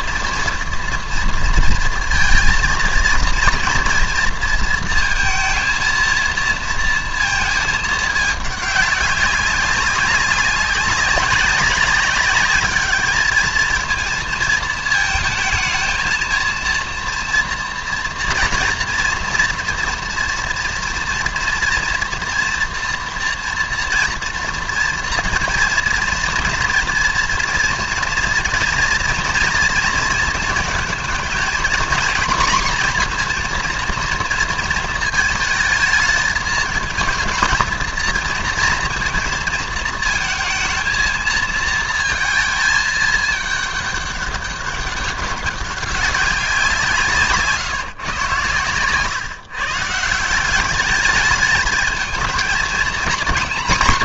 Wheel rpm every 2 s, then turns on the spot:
230, 230, 230, 230, 200, 190, 210, 220, 230, 230, 230, 230, 240, 230, 240, 230, 250, 230, 220, 220, 230, 220, 200, 180, 120, 200, 230.
none